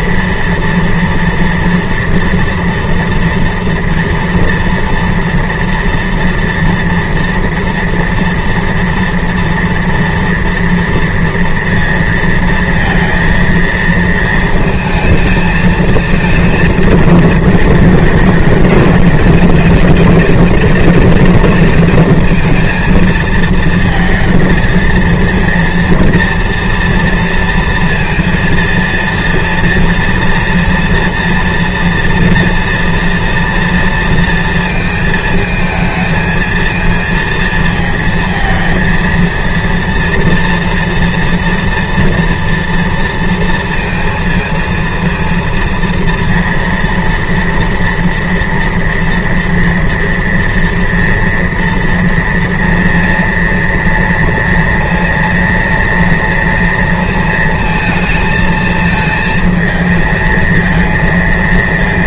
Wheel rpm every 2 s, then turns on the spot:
230, 230, 230, 230, 240, 230, 230, 230, 220, 220, 220, 220, 230, 230, 230, 230, 230, 230, 230, 230, 230, 230, 230, 230, 230, 230, 230, 230, 230, 220, 220.
none